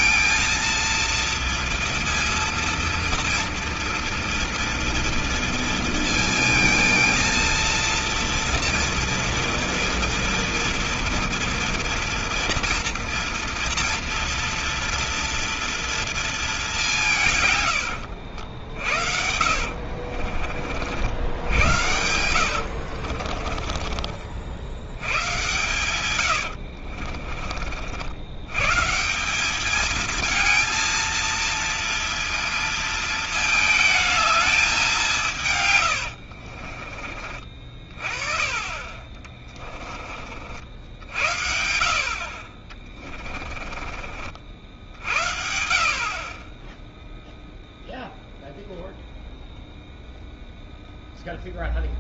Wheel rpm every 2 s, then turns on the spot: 230, 230, 230, 220, 230, 230, 230, 230, 180, 60, 70, 70, 90, 60, 150, 230, 230, 190, 50, 30, 70, 30, 50, 10, 0, 0.
18-20 22-24 26-28 36-40 42-44